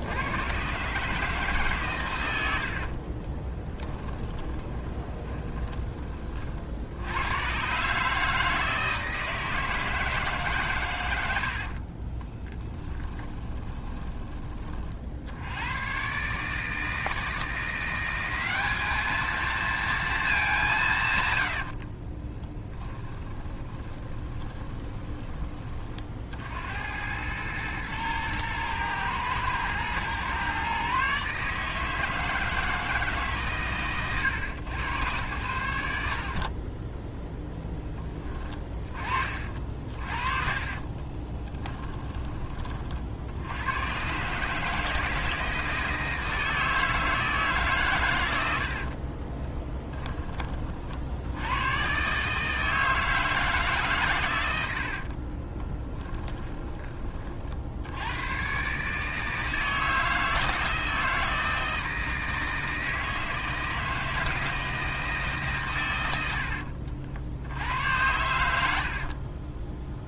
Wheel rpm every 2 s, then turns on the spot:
130, 60, 20, 70, 160, 120, 10, 40, 160, 210, 150, 20, 20, 90, 110, 140, 160, 100, 20, 30, 30, 40, 160, 160, 60, 50, 160, 70, 20, 140, 170, 160, 160, 60, 60.
2-6 12-14 22-26 36-38 40-42 48-50